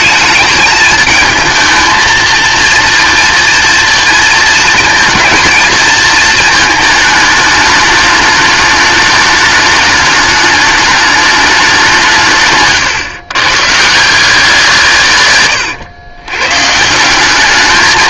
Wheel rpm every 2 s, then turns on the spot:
220, 230, 230, 220, 210, 210, 140, 160, 150.
12-14